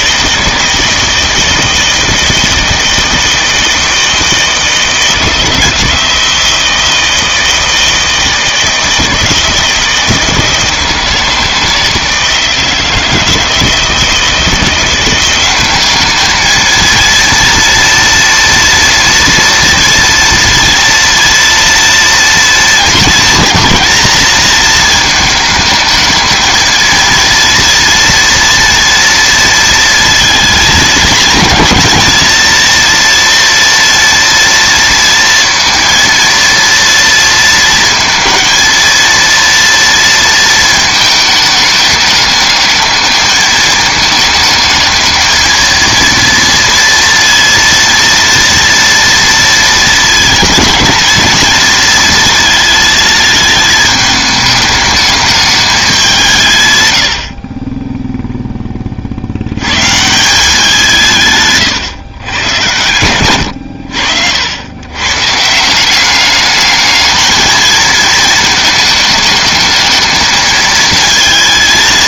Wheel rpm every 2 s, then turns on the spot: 160, 160, 160, 160, 160, 160, 160, 170, 230, 230, 230, 230, 220, 220, 230, 220, 230, 230, 230, 230, 220, 220, 220, 230, 240, 230, 230, 210, 90, 40, 170, 110, 120, 220, 220, 220.
none